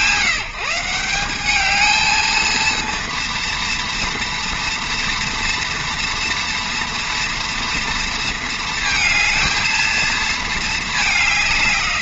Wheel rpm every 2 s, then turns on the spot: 180, 230, 230, 230, 230, 210.
none